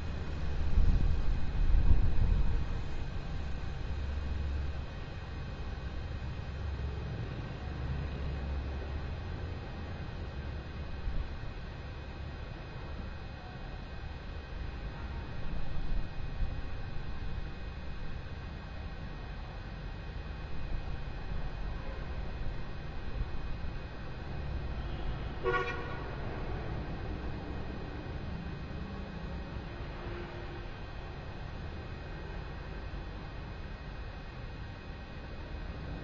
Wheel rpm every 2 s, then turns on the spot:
0, 0, 0, 0, 0, 0, 0, 0, 0, 0, 0, 0, 0, 0, 0, 0, 0, 0.
none